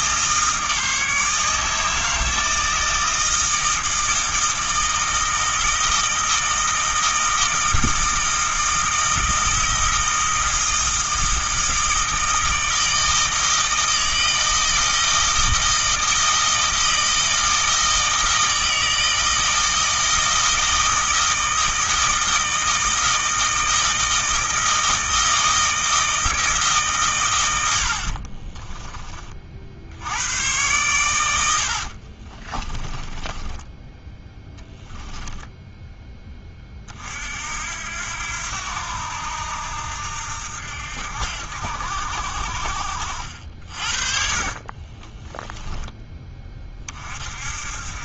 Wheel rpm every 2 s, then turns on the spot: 160, 160, 160, 160, 160, 160, 160, 160, 160, 160, 160, 160, 160, 130, 30, 110, 20, 10, 40, 80, 70, 60, 20, 40.
32-36 44-46